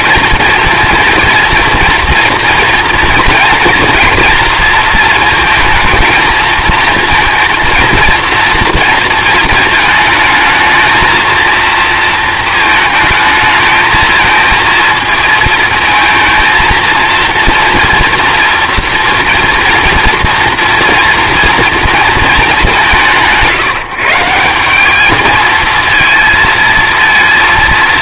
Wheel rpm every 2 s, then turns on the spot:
230, 230, 230, 220, 230, 220, 220, 220, 230, 230, 230, 170, 180, 230.
none